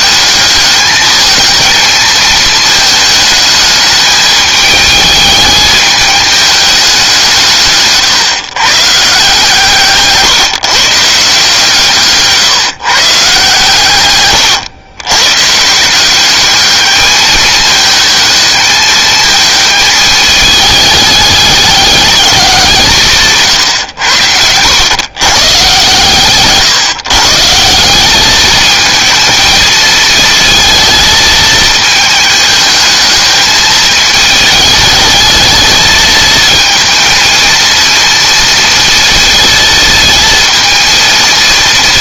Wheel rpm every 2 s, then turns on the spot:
220, 220, 210, 200, 150, 150, 150, 110, 210, 220, 210, 170, 100, 130, 220, 230, 220, 220, 230, 230, 230.
none